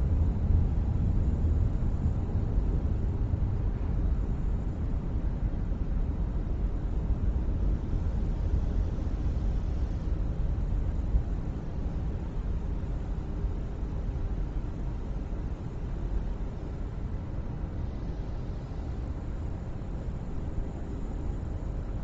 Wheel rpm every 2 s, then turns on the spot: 0, 0, 0, 0, 0, 0, 0, 0, 0, 0, 0.
none